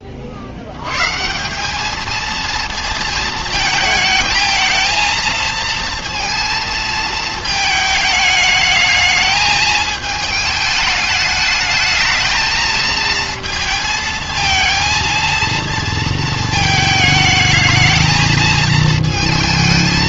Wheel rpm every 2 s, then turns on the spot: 60, 230, 220, 230, 220, 210, 220, 230, 220, 220.
none